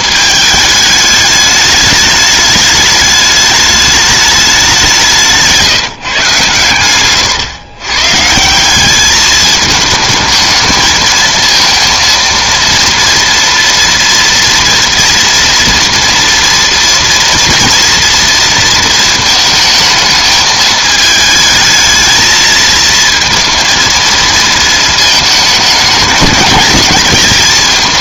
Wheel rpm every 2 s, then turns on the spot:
210, 210, 200, 140, 180, 220, 230, 230, 240, 230, 220, 220, 230, 220.
6-8